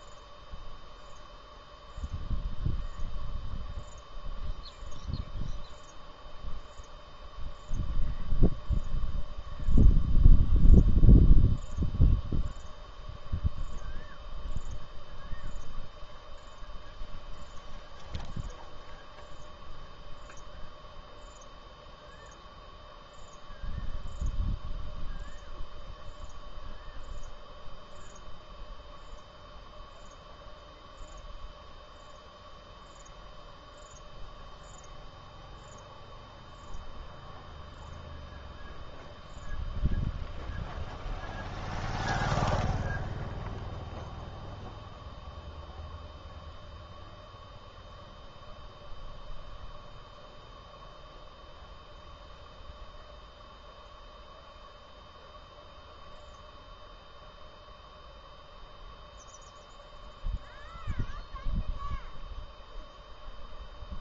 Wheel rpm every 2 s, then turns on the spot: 0, 0, 0, 0, 0, 0, 0, 0, 0, 0, 0, 0, 0, 0, 0, 0, 0, 0, 0, 0, 0, 0, 0, 0, 0, 0, 0, 0, 0, 0, 0, 0.
none